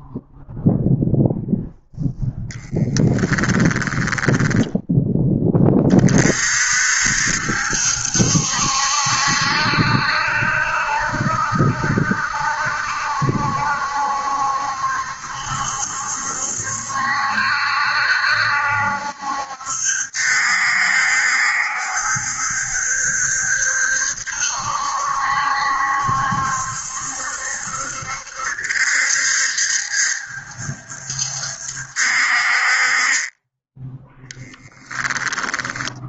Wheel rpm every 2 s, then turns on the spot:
0, 10, 10, 60, 70, 70, 70, 70, 70, 70, 70, 70, 70, 70, 70, 70, 30, 20.
2-4 32-34